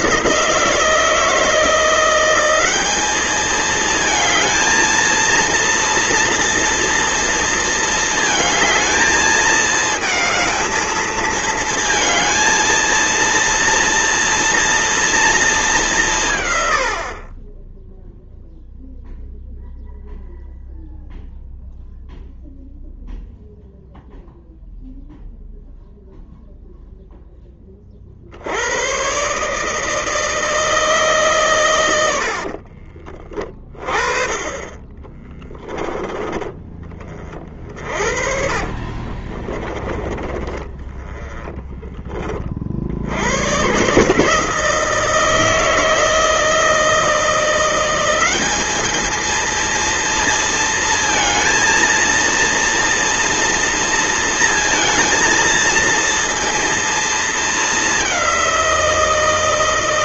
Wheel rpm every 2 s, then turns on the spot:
160, 200, 220, 230, 220, 220, 230, 230, 110, 0, 0, 0, 0, 0, 90, 160, 50, 20, 20, 40, 20, 60, 160, 160, 200, 230, 230, 230, 230, 180.
32-34 38-40